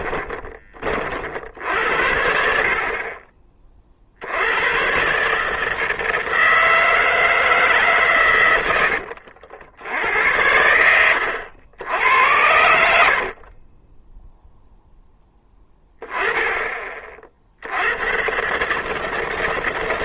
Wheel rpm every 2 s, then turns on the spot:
60, 30, 120, 160, 80, 80, 80, 0, 20, 140.
8-10